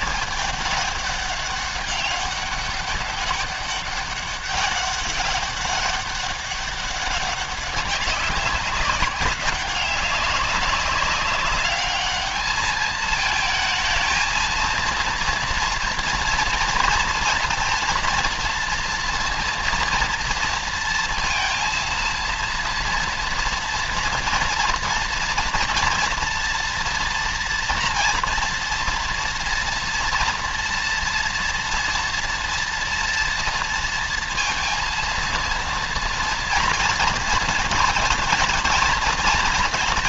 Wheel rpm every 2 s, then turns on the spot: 210, 200, 200, 200, 190, 200, 220, 230, 230, 230, 230, 230, 240, 230, 230, 230, 240, 230, 240, 230.
none